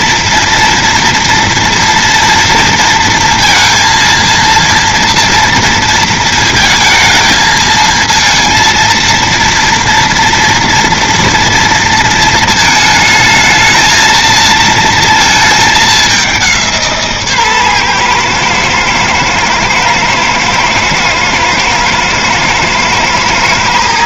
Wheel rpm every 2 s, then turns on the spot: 230, 230, 230, 220, 230, 230, 220, 230, 180, 120, 110, 110.
none